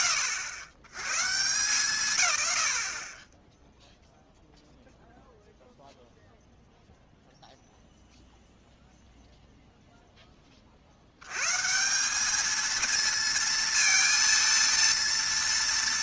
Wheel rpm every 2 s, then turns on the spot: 100, 30, 0, 0, 0, 50, 230, 230.
none